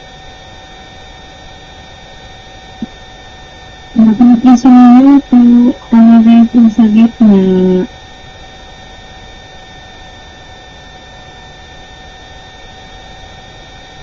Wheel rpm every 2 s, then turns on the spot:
0, 0, 0, 0, 0, 0, 0.
none